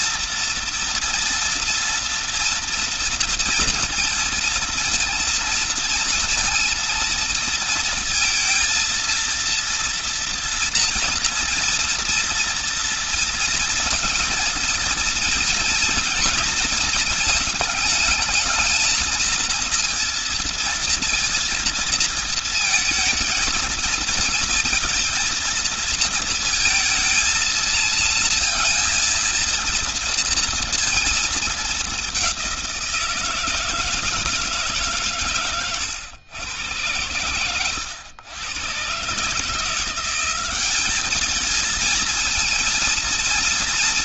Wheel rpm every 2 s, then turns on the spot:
240, 230, 230, 230, 230, 230, 230, 230, 230, 220, 230, 230, 230, 230, 230, 230, 180, 160, 110, 100, 190, 230.
none